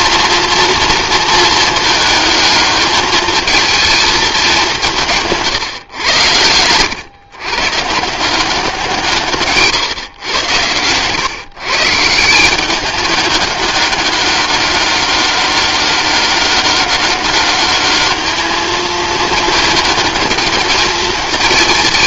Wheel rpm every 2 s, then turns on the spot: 230, 210, 190, 110, 180, 110, 200, 200, 190, 220, 220.
none